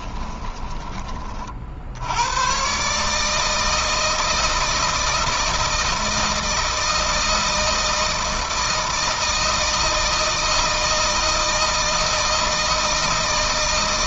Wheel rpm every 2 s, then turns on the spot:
20, 130, 160, 160, 160, 160, 160.
none